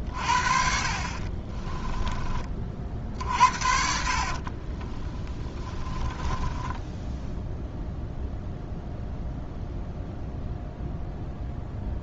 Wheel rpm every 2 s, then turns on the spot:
40, 50, 30, 10, 0, 0.
4-8